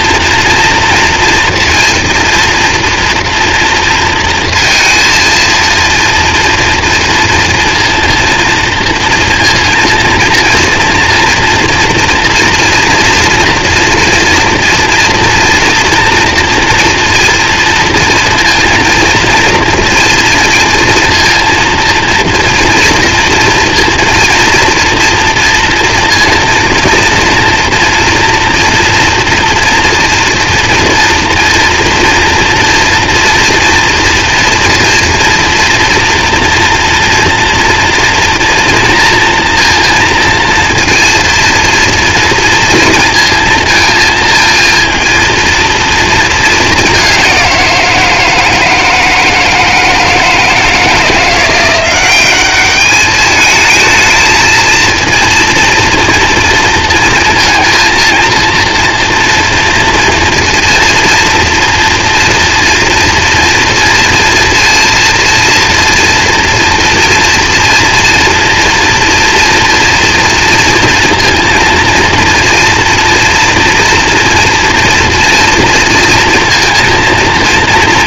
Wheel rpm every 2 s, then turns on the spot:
230, 230, 230, 230, 230, 230, 230, 230, 230, 230, 230, 230, 230, 230, 230, 240, 230, 230, 230, 230, 230, 230, 230, 200, 160, 160, 210, 230, 230, 230, 230, 230, 230, 230, 240, 230, 230, 230, 230.
none